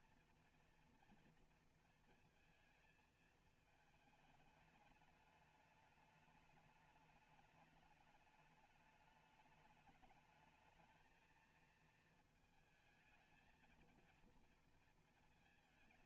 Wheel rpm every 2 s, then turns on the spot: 240, 220, 210, 210, 210, 220, 220, 230.
none